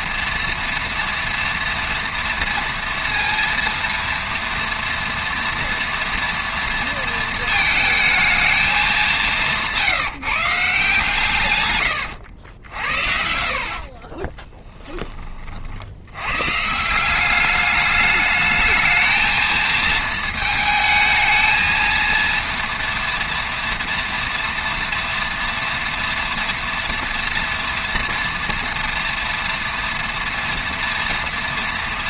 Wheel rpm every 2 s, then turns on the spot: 230, 230, 230, 230, 210, 160, 70, 20, 140, 220, 220, 230, 230, 230, 230, 230.
14-16